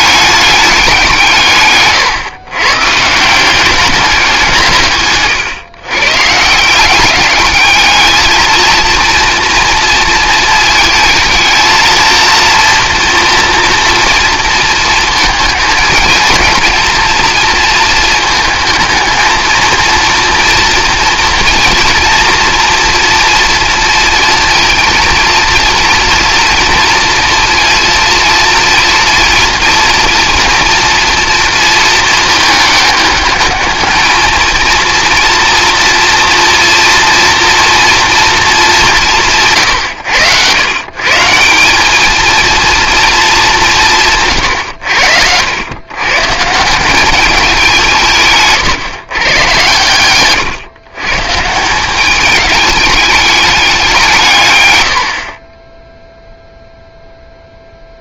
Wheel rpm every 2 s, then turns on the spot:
200, 130, 160, 180, 230, 230, 230, 230, 230, 220, 230, 230, 230, 230, 230, 230, 220, 230, 240, 200, 120, 230, 100, 160, 140, 130, 210, 100, 0.
44-46